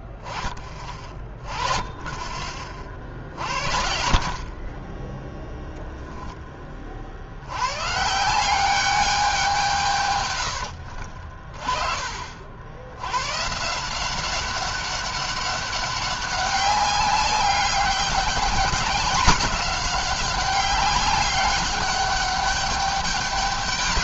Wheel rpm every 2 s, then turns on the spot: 20, 30, 40, 10, 170, 100, 60, 190, 200, 190, 190, 200.
10-12